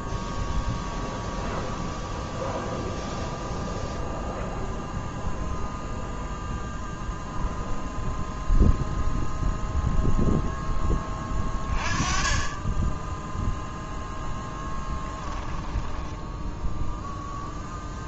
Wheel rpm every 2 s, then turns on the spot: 0, 0, 0, 0, 0, 10, 10, 10, 0.
14-16